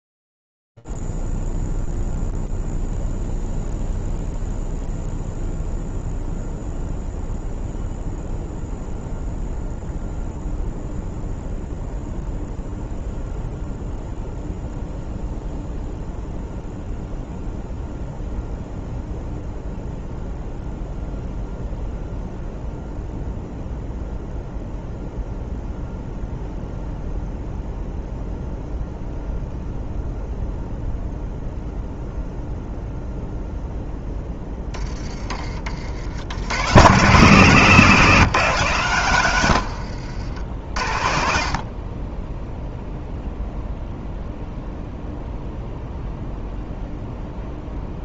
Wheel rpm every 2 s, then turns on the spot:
0, 0, 0, 0, 0, 0, 0, 0, 0, 0, 0, 0, 0, 0, 0, 0, 0, 20, 110, 140, 70, 0, 0, 0.
38-40